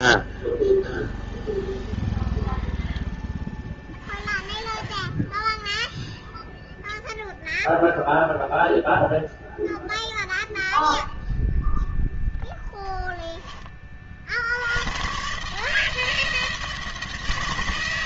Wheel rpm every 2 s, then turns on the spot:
0, 0, 30, 0, 0, 0, 0, 80, 160.
none